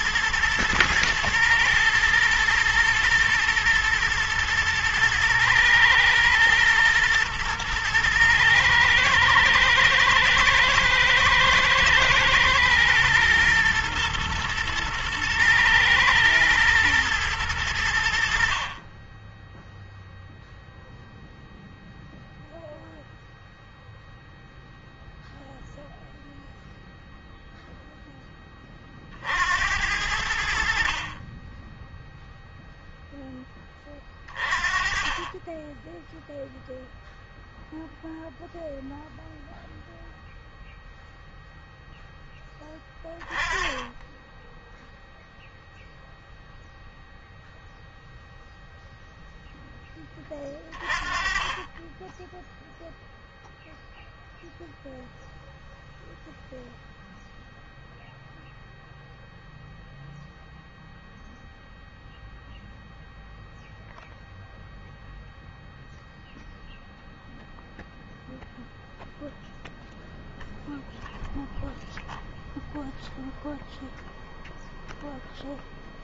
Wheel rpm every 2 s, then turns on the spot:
120, 110, 110, 120, 110, 120, 120, 120, 110, 20, 0, 0, 0, 0, 40, 50, 0, 30, 0, 0, 0, 10, 0, 0, 0, 30, 0, 0, 0, 0, 0, 0, 0, 0, 0, 0, 0, 0.
none